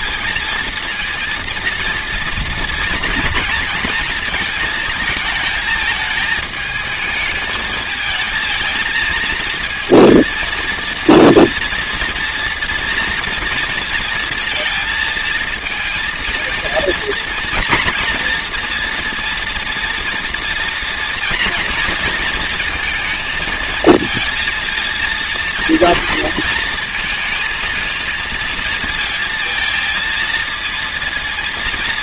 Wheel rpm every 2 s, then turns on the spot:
230, 230, 220, 220, 220, 230, 230, 230, 220, 230, 230, 230, 230, 220, 230, 230.
none